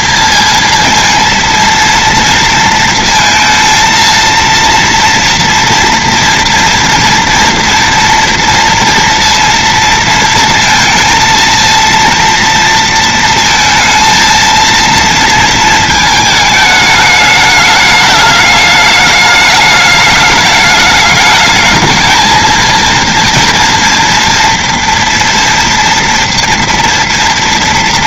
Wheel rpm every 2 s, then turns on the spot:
230, 230, 230, 230, 230, 230, 230, 220, 220, 210, 210, 220, 230, 230.
none